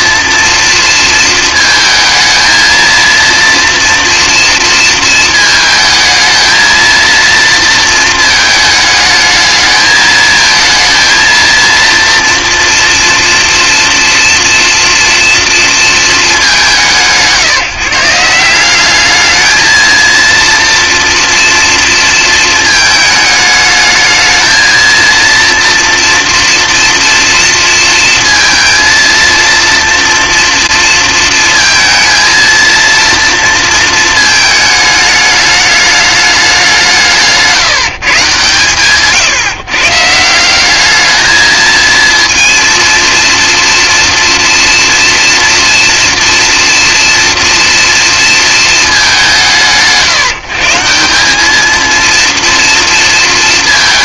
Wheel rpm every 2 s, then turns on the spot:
230, 230, 230, 230, 220, 230, 230, 230, 180, 200, 230, 220, 230, 230, 230, 230, 230, 220, 190, 130, 200, 230, 240, 230, 220, 170, 230.
none